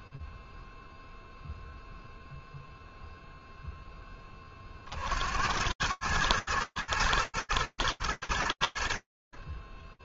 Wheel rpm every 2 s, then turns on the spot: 0, 0, 80, 110, 60.
none